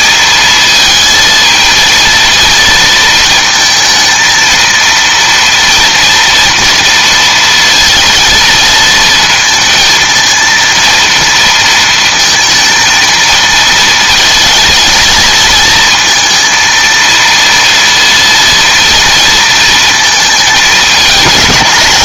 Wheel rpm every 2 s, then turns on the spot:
220, 230, 230, 230, 230, 230, 230, 220, 230, 230, 220.
none